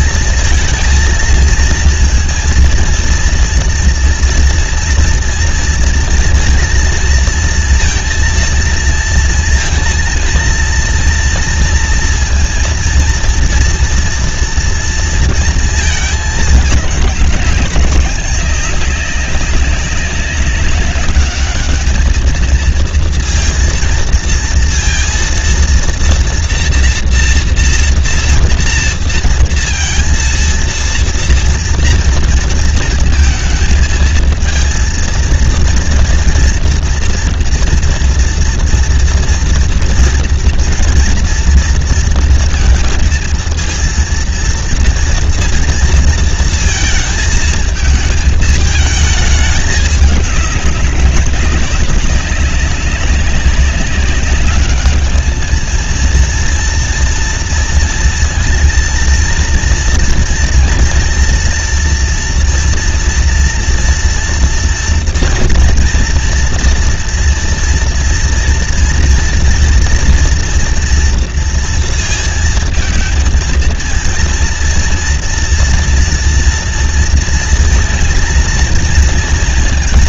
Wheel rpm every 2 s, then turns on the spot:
230, 230, 230, 230, 230, 230, 230, 230, 220, 200, 200, 220, 230, 240, 230, 230, 230, 230, 240, 230, 230, 230, 230, 230, 220, 200, 190, 200, 230, 230, 230, 230, 230, 230, 230, 230, 230, 230, 230, 230.
none